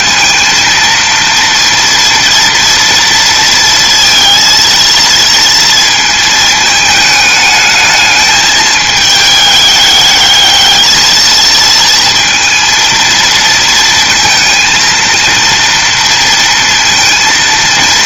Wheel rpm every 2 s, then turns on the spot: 230, 230, 230, 220, 210, 220, 230, 230, 230.
none